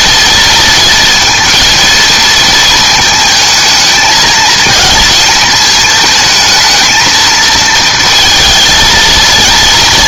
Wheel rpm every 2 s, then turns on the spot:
230, 220, 220, 220, 230.
none